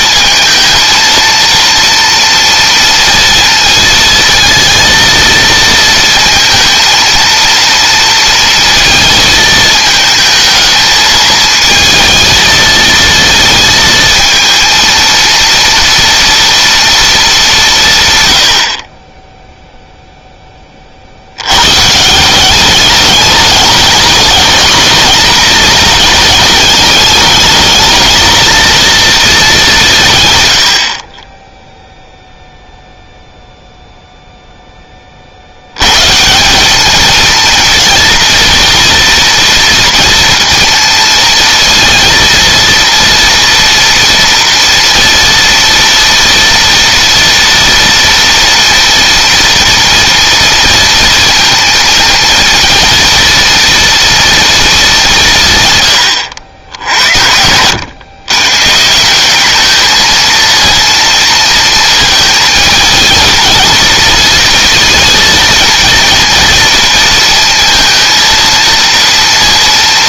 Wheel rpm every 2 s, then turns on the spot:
230, 230, 230, 230, 220, 220, 230, 230, 230, 40, 50, 200, 220, 210, 230, 50, 0, 20, 220, 240, 230, 230, 230, 230, 230, 230, 230, 210, 70, 170, 230, 220, 230, 230, 230.
none